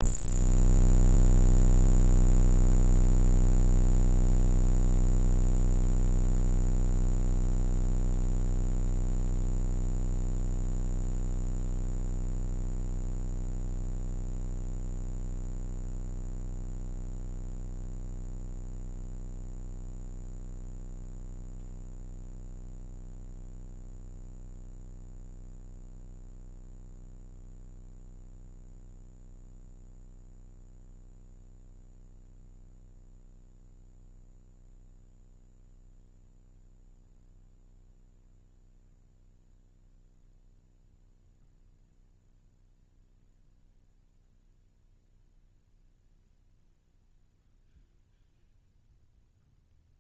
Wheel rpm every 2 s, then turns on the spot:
0, 0, 0, 0, 0, 0, 0, 0, 0, 0, 0, 0, 0, 0, 0, 0, 0, 0, 0, 0, 0, 0, 0, 0, 0.
none